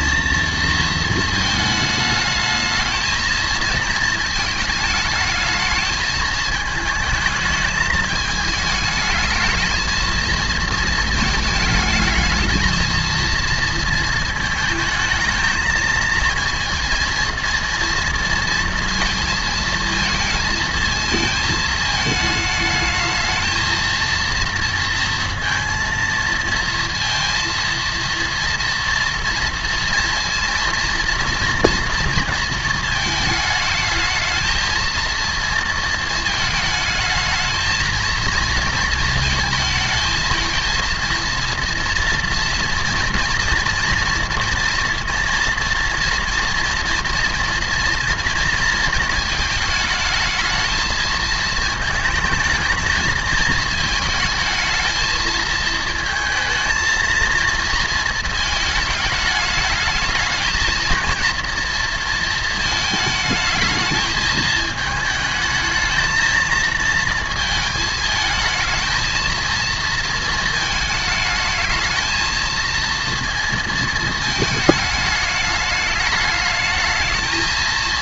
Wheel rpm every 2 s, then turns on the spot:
230, 220, 220, 220, 220, 230, 220, 220, 230, 230, 220, 220, 230, 230, 230, 240, 230, 230, 220, 230, 220, 230, 230, 230, 230, 220, 220, 220, 220, 220, 220, 220, 220, 230, 220, 220, 230, 220, 220.
none